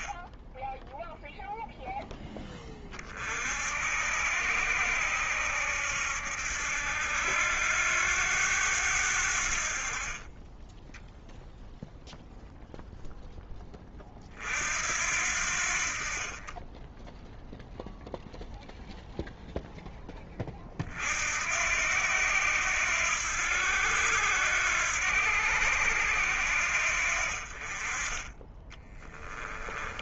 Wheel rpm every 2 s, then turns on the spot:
20, 10, 70, 70, 90, 20, 0, 40, 30, 0, 20, 80, 80, 80, 30.
none